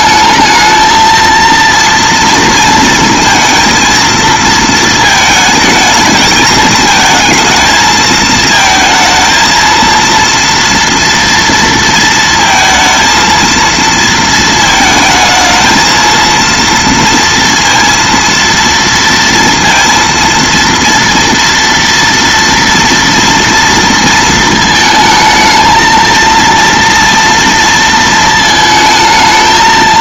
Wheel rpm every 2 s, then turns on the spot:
220, 230, 230, 220, 220, 230, 230, 220, 230, 230, 230, 230, 220, 230, 220.
none